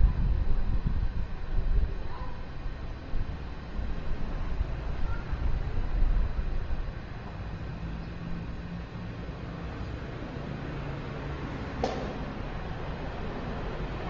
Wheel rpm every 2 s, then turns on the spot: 0, 0, 0, 0, 0, 0, 0.
none